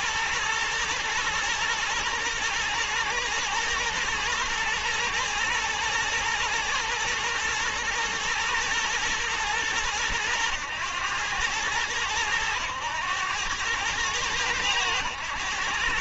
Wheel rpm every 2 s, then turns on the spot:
120, 110, 110, 110, 110, 100, 100, 100.
none